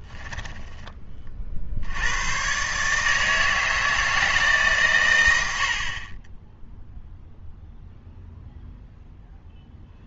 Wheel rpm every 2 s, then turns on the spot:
10, 130, 150, 0, 0.
none